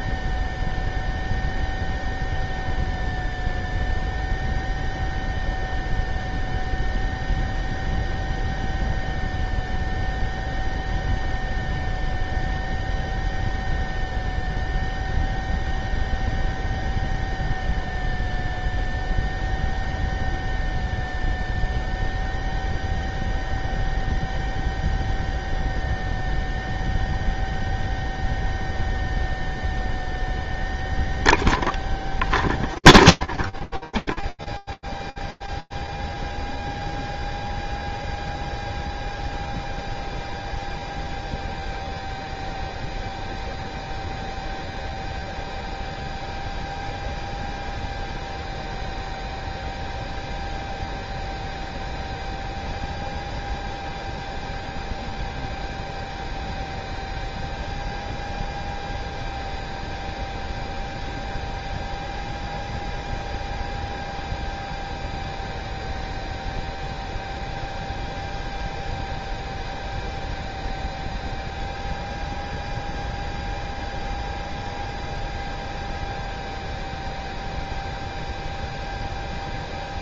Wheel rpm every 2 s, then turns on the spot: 0, 0, 0, 0, 0, 0, 0, 0, 0, 0, 0, 0, 0, 0, 0, 0, 0, 0, 0, 0, 0, 0, 0, 0, 0, 0, 0, 0, 0, 0, 0, 0, 0, 0, 0, 0, 0, 0, 0, 0.
none